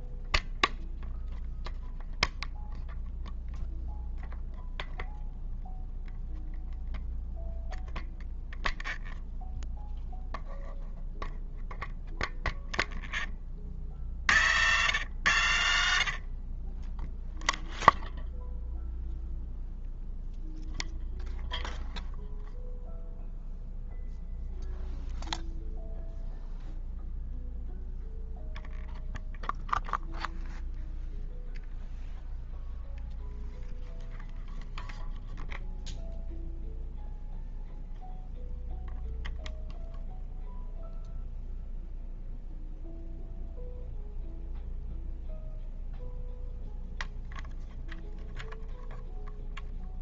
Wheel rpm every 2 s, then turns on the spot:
0, 0, 0, 0, 0, 0, 0, 90, 40, 0, 0, 0, 0, 0, 0, 0, 0, 0, 0, 0, 0, 0, 0, 0, 0.
none